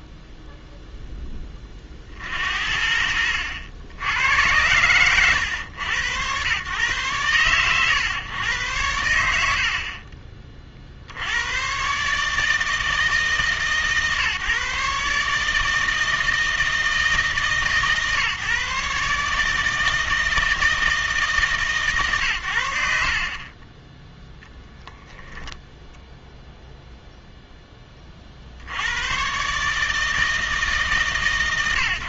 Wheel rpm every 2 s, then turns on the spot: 0, 60, 110, 110, 100, 40, 160, 140, 160, 140, 160, 70, 10, 0, 80, 150.
none